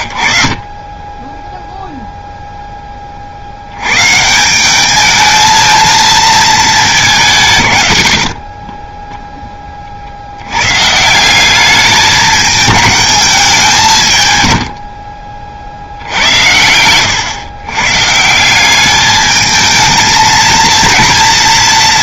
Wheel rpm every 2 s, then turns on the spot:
30, 10, 190, 220, 30, 110, 210, 110, 100, 190, 220.
8-10 14-16